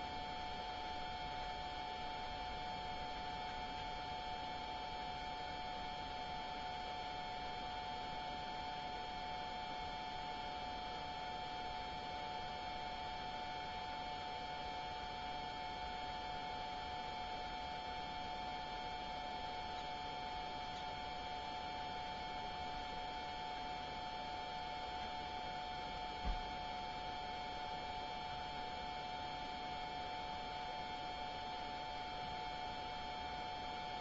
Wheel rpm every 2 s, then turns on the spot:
0, 0, 0, 0, 0, 0, 0, 0, 0, 0, 0, 0, 0, 0, 0, 0, 0.
none